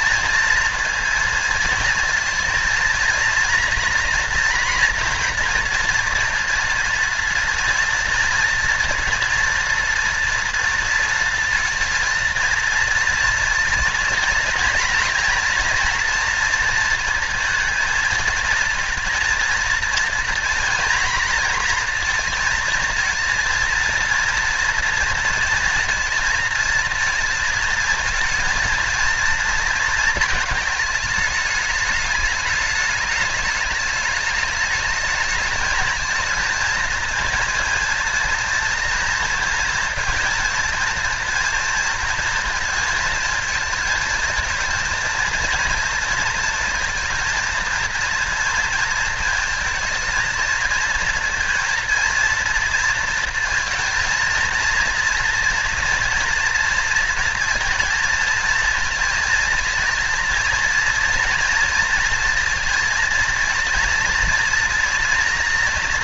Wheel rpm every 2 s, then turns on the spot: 230, 230, 230, 230, 230, 230, 230, 230, 230, 220, 230, 230, 240, 230, 230, 220, 210, 210, 230, 230, 240, 230, 230, 230, 230, 230, 230, 230, 240, 230, 230, 230, 230.
none